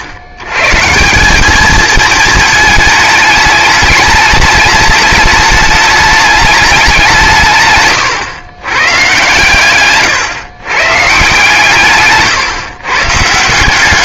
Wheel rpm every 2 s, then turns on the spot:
120, 220, 210, 210, 130, 130, 140.
none